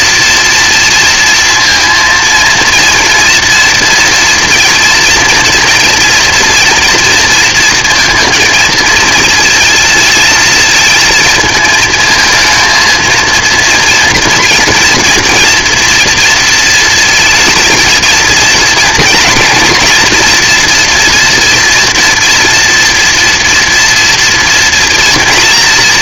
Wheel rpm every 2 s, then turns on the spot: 240, 230, 230, 230, 230, 230, 220, 230, 230, 230, 240, 230, 230.
none